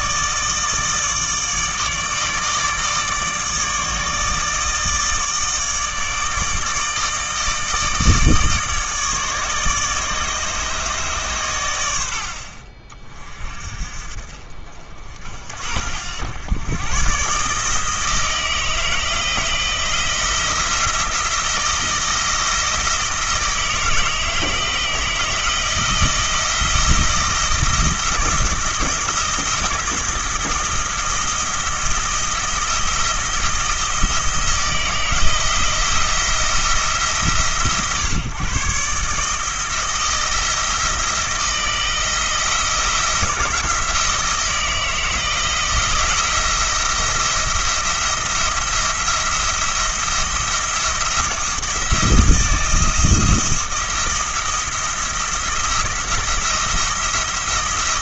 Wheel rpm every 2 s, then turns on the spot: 160, 150, 160, 160, 150, 150, 40, 50, 120, 160, 170, 160, 160, 160, 170, 160, 170, 160, 160, 140, 170, 170, 170, 170, 170, 170, 170, 170, 170.
none